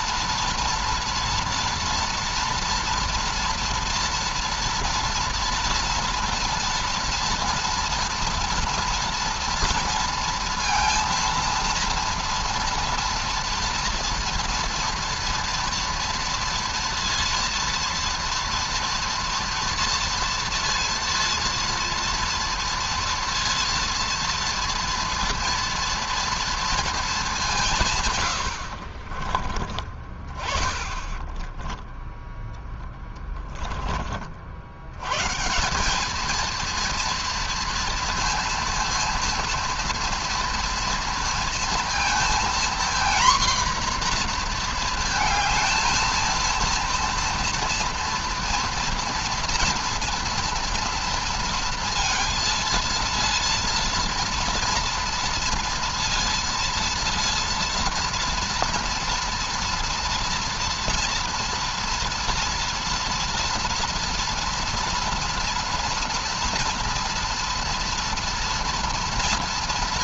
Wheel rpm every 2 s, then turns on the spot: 230, 230, 230, 230, 230, 230, 230, 230, 230, 230, 230, 230, 230, 220, 50, 20, 10, 80, 230, 230, 230, 240, 230, 230, 230, 230, 230, 230, 230, 230, 230, 230, 230, 230, 230.
28-30 32-34